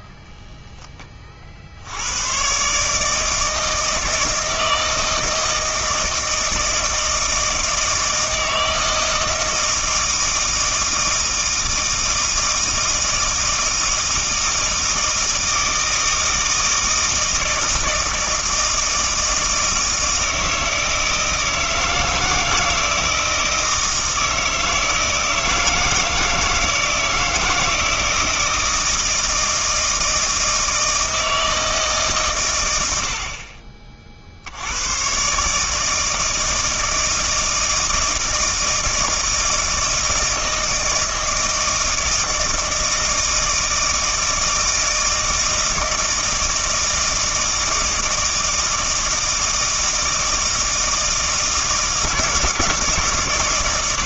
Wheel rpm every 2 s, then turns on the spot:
10, 140, 160, 160, 160, 160, 160, 160, 160, 160, 160, 160, 160, 160, 160, 160, 100, 90, 160, 160, 160, 160, 160, 160, 160, 160, 150.
none